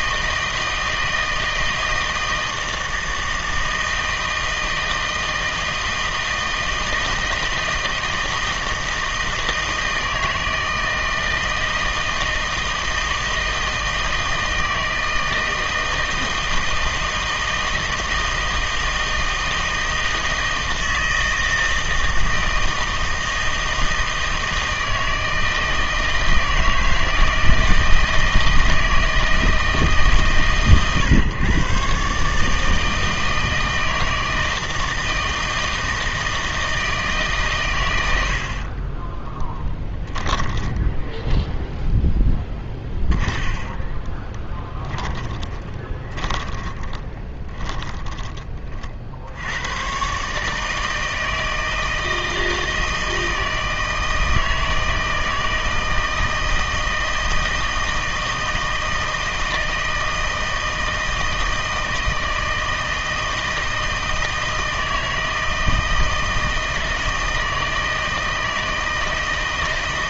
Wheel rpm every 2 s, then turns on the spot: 160, 160, 160, 160, 160, 160, 160, 160, 160, 160, 160, 160, 160, 160, 160, 120, 150, 160, 160, 30, 10, 10, 10, 30, 30, 150, 160, 160, 160, 160, 160, 160, 160, 160, 160.
38-48